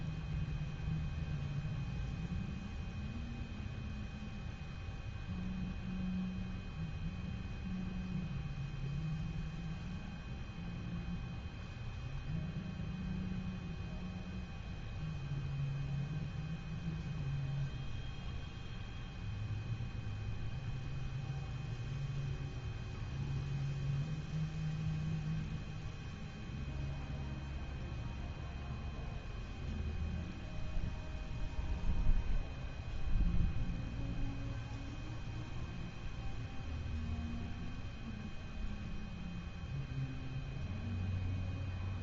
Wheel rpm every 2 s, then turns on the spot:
0, 0, 0, 0, 0, 0, 0, 0, 0, 0, 0, 0, 0, 0, 0, 0, 0, 0, 0, 0, 0.
none